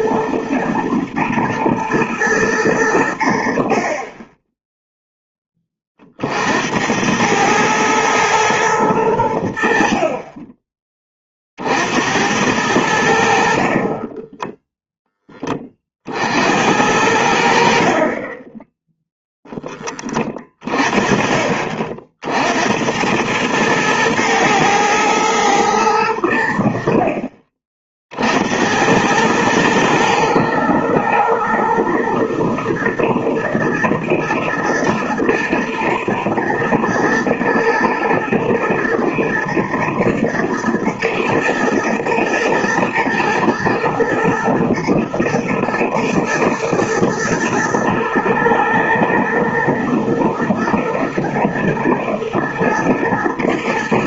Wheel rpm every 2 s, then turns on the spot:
120, 100, 10, 80, 110, 20, 90, 0, 70, 10, 30, 80, 110, 70, 80, 110, 120, 110, 110, 110, 120, 120, 120, 110, 110, 120, 120.
18-20